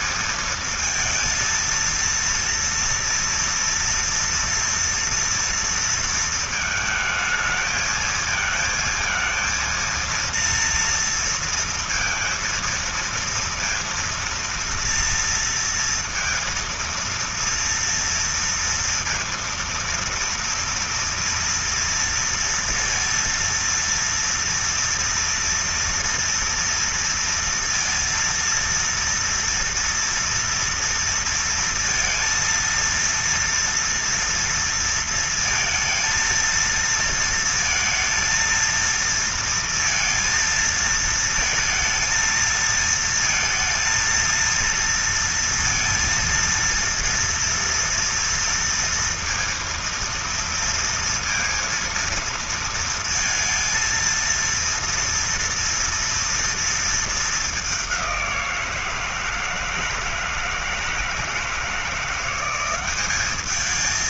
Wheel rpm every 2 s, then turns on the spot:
230, 230, 230, 220, 220, 230, 230, 230, 230, 230, 230, 230, 240, 230, 230, 230, 230, 230, 230, 230, 230, 230, 230, 230, 230, 230, 230, 230, 230, 170, 160, 190.
none